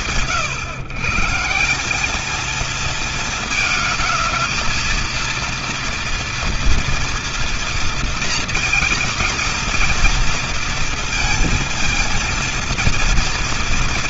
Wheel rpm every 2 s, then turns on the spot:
120, 220, 230, 230, 230, 230, 230.
none